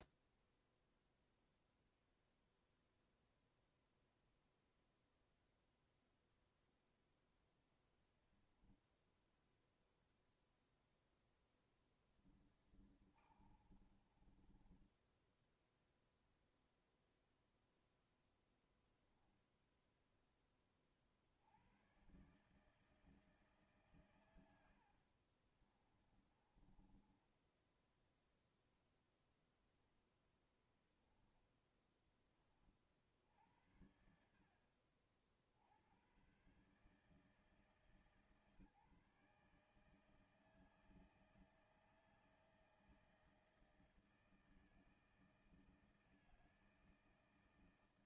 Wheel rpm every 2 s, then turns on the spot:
0, 0, 0, 0, 0, 0, 20, 20, 0, 0, 10, 130, 110, 20, 0, 0, 20, 60, 110, 150, 160, 160, 160, 160.
12-16 26-28